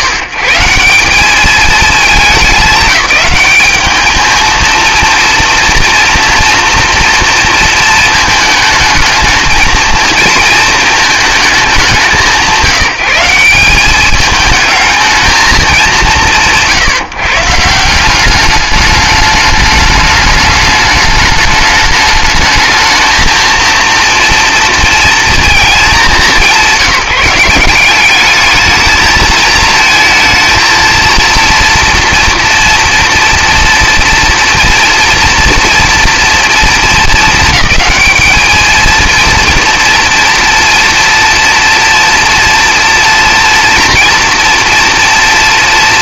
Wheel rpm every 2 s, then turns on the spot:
130, 200, 220, 230, 220, 230, 160, 220, 180, 200, 210, 210, 230, 180, 210, 220, 230, 230, 230, 220, 230, 230, 230.
none